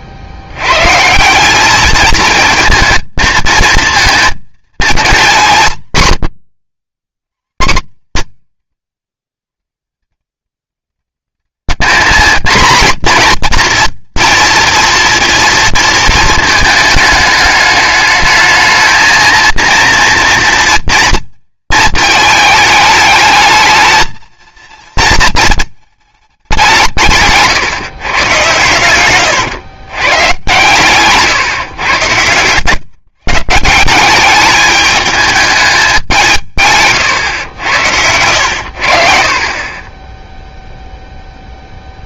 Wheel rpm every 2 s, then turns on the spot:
100, 230, 230, 110, 130, 140, 240, 230, 220, 220, 230, 220, 230, 180, 100, 130, 130, 210, 140, 80, 0.
none